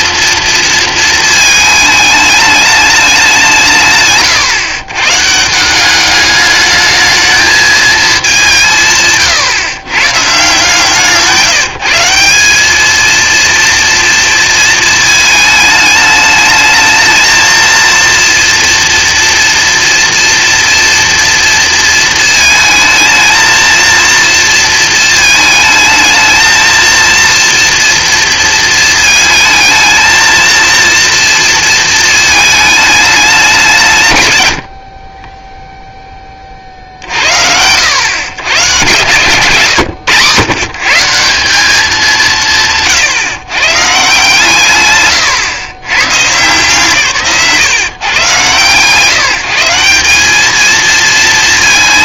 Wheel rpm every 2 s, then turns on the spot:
230, 200, 130, 210, 150, 160, 210, 230, 220, 230, 230, 220, 220, 230, 220, 230, 220, 100, 60, 130, 150, 150, 130, 140, 130, 220.
none